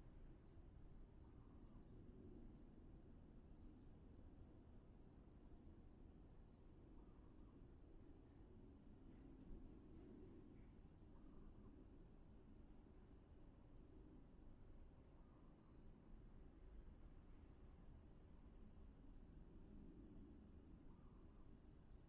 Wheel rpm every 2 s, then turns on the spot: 0, 0, 0, 0, 0, 0, 0, 0, 0, 0, 0.
none